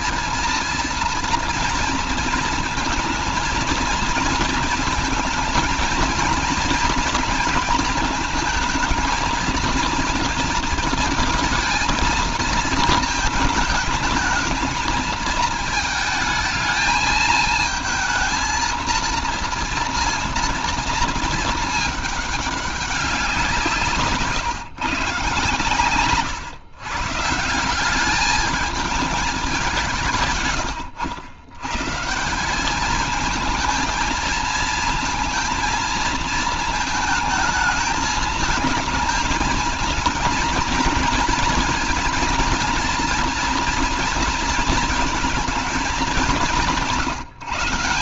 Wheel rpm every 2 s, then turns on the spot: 230, 230, 230, 230, 220, 230, 230, 220, 220, 230, 230, 200, 140, 120, 220, 110, 200, 230, 220, 220, 230, 230, 230, 190.
none